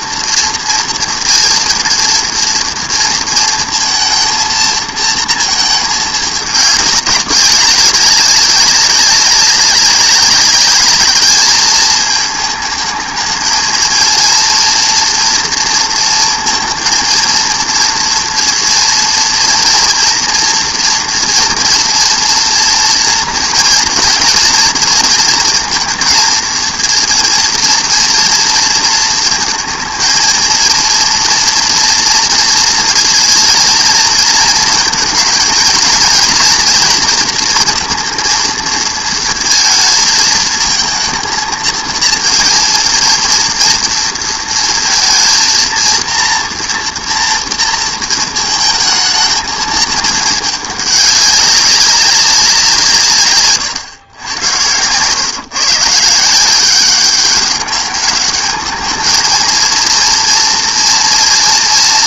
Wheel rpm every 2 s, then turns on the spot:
230, 230, 230, 200, 200, 210, 220, 230, 230, 230, 240, 230, 240, 230, 230, 230, 230, 230, 230, 230, 220, 230, 230, 240, 220, 210, 170, 100, 180, 220, 230.
none